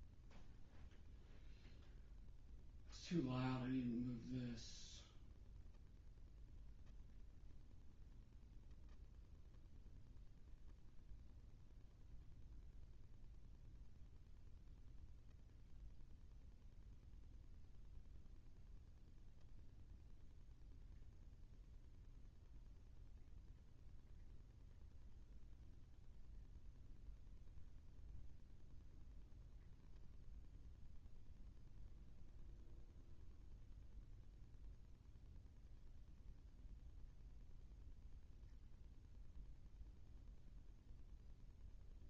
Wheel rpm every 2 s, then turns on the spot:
0, 0, 0, 0, 0, 0, 0, 0, 0, 0, 0, 0, 0, 0, 0, 0, 0, 0, 0, 0, 0.
none